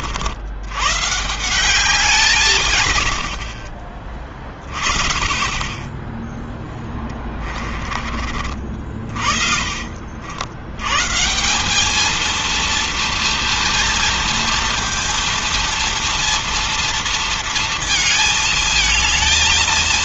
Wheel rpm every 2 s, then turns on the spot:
90, 160, 30, 10, 40, 90, 230, 230, 230, 220.
none